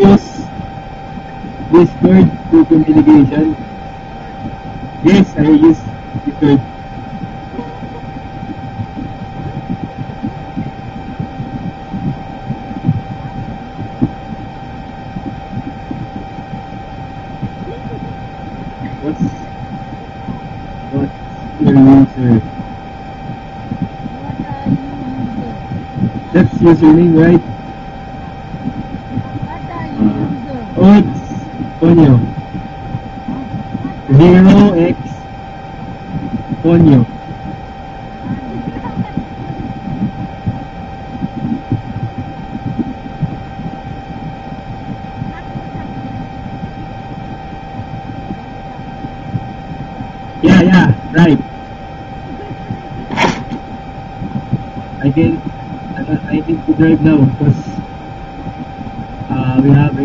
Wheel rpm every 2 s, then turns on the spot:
0, 0, 0, 0, 0, 0, 0, 0, 0, 0, 0, 0, 0, 0, 0, 0, 0, 0, 0, 0, 0, 0, 0, 0, 0, 0, 0, 0, 0, 0.
none